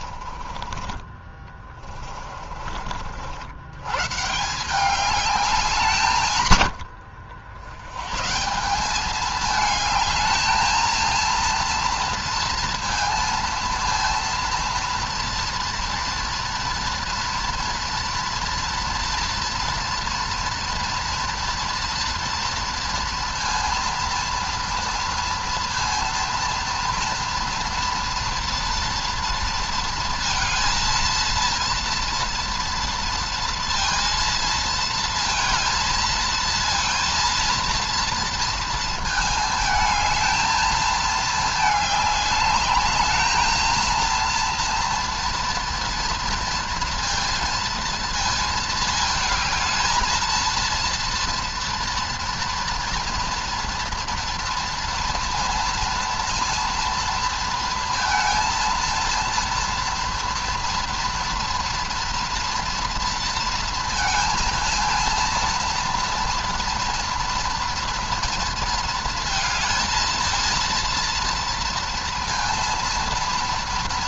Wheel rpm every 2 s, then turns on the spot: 30, 40, 170, 120, 160, 220, 230, 230, 230, 230, 240, 230, 230, 230, 230, 230, 230, 230, 230, 230, 220, 200, 230, 230, 230, 230, 230, 230, 230, 230, 240, 240, 230, 230, 230, 230, 230.
0-2